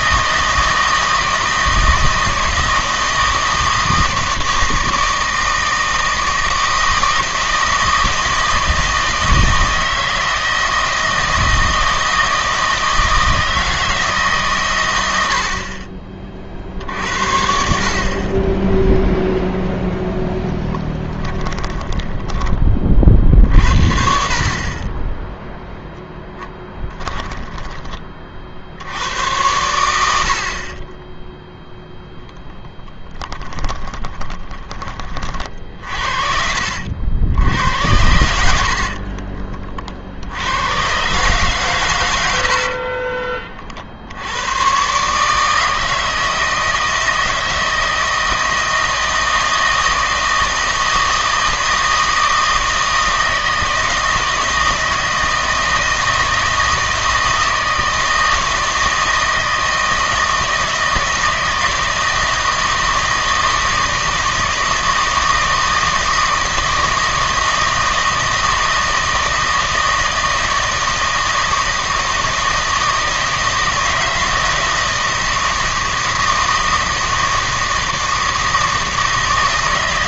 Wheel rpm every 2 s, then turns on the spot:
160, 160, 160, 160, 160, 160, 160, 120, 60, 10, 10, 30, 30, 20, 80, 30, 20, 20, 70, 60, 110, 40, 120, 160, 160, 160, 160, 160, 160, 160, 160, 160, 160, 160, 160, 160, 160, 160, 160, 160.
20-22 26-28 32-34 38-40 42-44